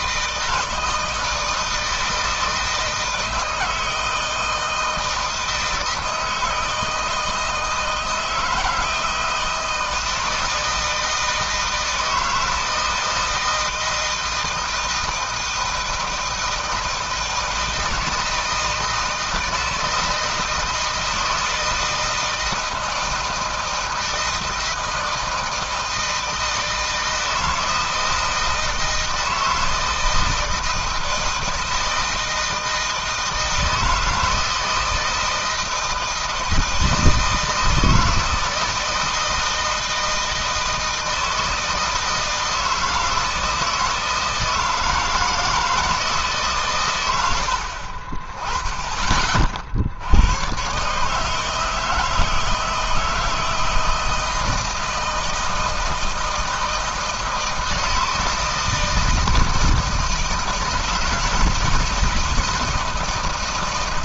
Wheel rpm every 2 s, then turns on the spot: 160, 160, 160, 160, 160, 160, 160, 160, 160, 160, 160, 160, 160, 160, 160, 160, 160, 160, 160, 160, 160, 160, 160, 150, 40, 110, 160, 160, 160, 160, 160, 170.
none